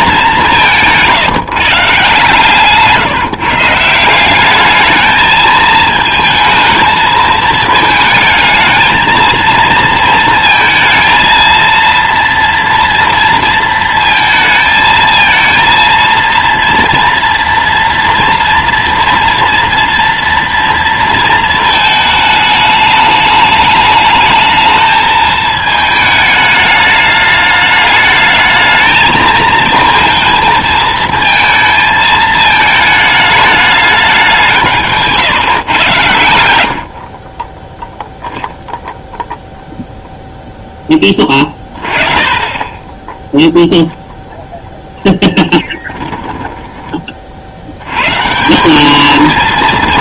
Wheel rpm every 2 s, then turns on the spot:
170, 150, 210, 220, 220, 220, 230, 220, 230, 240, 230, 210, 220, 210, 220, 220, 220, 160, 70, 0, 10, 20, 0, 20, 190.
none